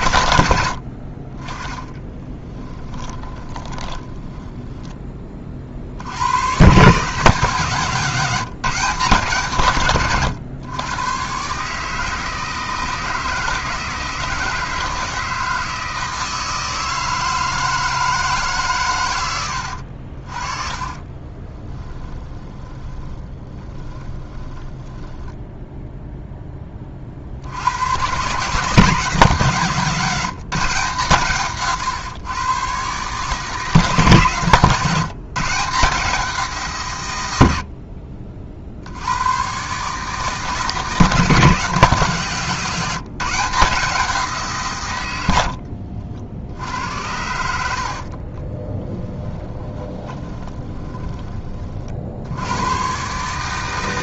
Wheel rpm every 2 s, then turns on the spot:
70, 10, 10, 140, 160, 120, 160, 160, 160, 150, 30, 20, 10, 20, 160, 170, 130, 140, 150, 60, 160, 170, 150, 70, 20, 20, 100.
2-4 20-26 48-52